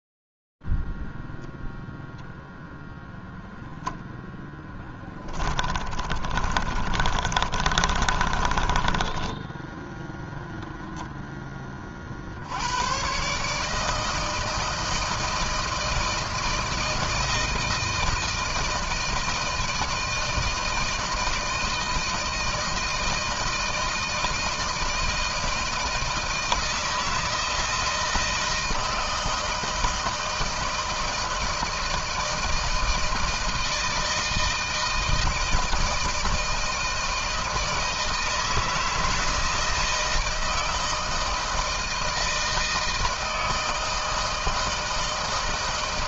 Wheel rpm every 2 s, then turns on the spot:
0, 0, 10, 30, 30, 0, 80, 160, 160, 160, 160, 160, 160, 160, 160, 160, 160, 160, 160, 160, 160, 160, 160.
4-10